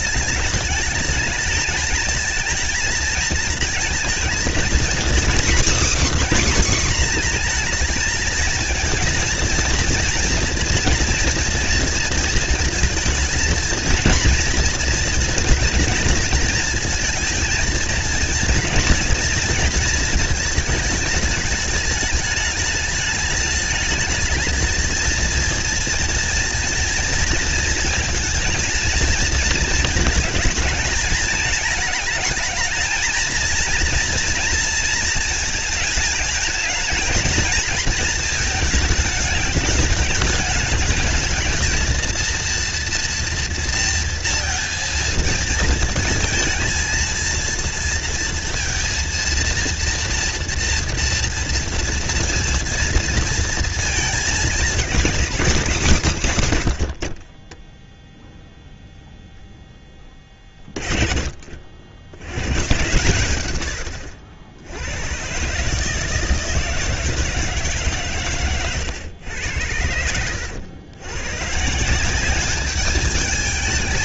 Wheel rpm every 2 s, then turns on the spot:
220, 220, 240, 260, 220, 230, 230, 230, 230, 230, 220, 220, 220, 230, 230, 220, 220, 230, 210, 210, 210, 230, 230, 220, 230, 230, 230, 210, 80, 0, 30, 120, 90, 160, 120, 100, 200.
none